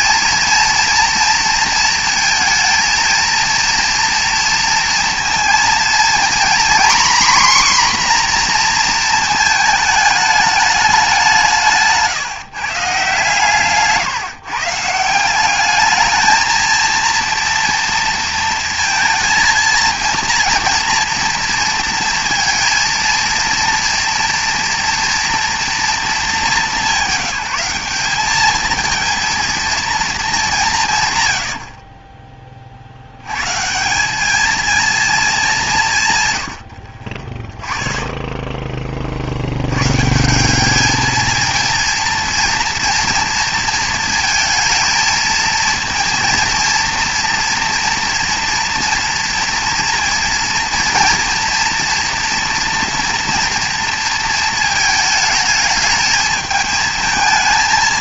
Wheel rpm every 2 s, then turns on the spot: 230, 230, 230, 250, 240, 210, 150, 160, 220, 230, 230, 230, 230, 210, 220, 180, 40, 220, 80, 20, 200, 230, 220, 230, 230, 230, 230, 220, 220.
none